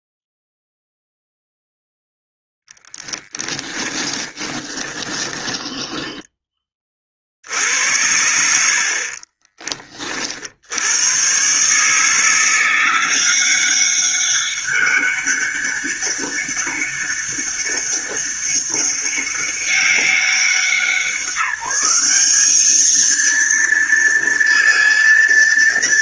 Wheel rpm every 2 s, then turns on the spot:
0, 10, 20, 30, 50, 90, 180, 200, 200, 200, 190, 220, 230.
2-6